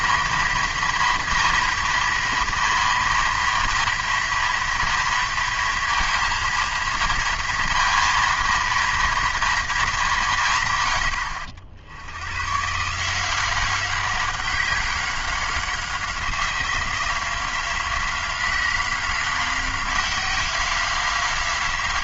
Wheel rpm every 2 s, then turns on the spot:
230, 230, 230, 230, 230, 140, 140, 190, 180, 190, 190.
none